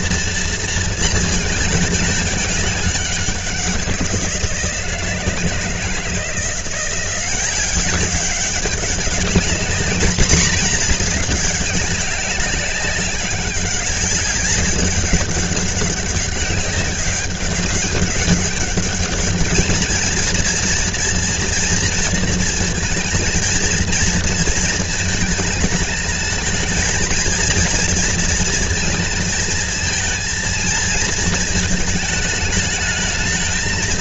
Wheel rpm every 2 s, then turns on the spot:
220, 200, 160, 180, 200, 210, 190, 200, 200, 200, 230, 230, 220, 230, 230, 230, 220.
none